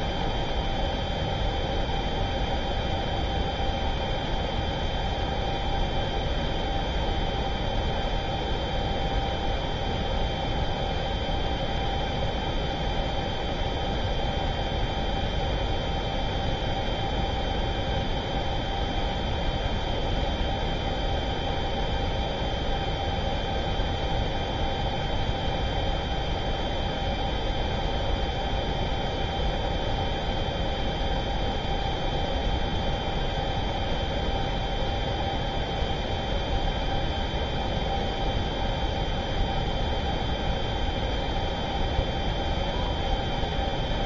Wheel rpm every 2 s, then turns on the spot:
0, 0, 0, 0, 0, 0, 0, 0, 0, 0, 0, 0, 0, 0, 0, 0, 0, 0, 0, 0, 0, 0.
none